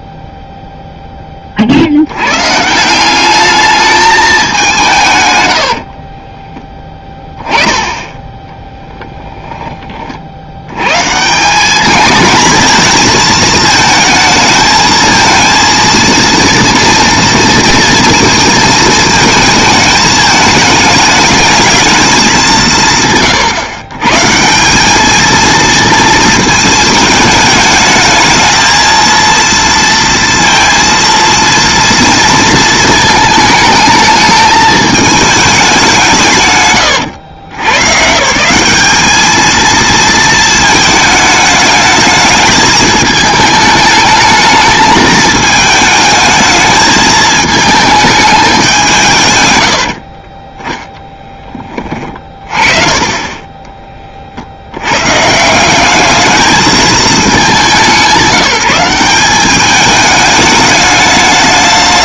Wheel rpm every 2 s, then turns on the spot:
0, 150, 180, 10, 10, 100, 230, 220, 230, 220, 210, 170, 190, 220, 220, 230, 230, 210, 130, 190, 220, 220, 220, 220, 170, 10, 30, 80, 220, 190, 210.
8-10